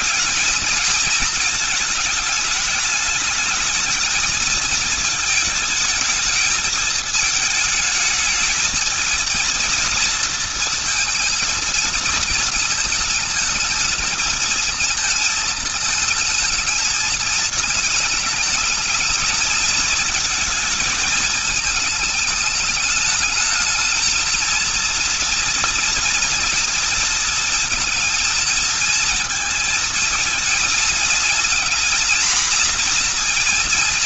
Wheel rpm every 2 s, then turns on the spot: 220, 210, 220, 220, 230, 220, 220, 220, 220, 220, 230, 210, 230, 230, 230, 220, 240.
none